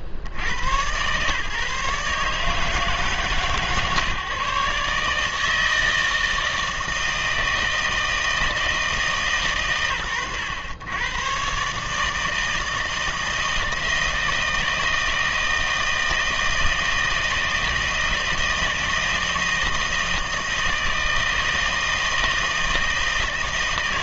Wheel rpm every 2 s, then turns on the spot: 80, 150, 140, 160, 160, 100, 160, 160, 160, 160, 160, 160.
none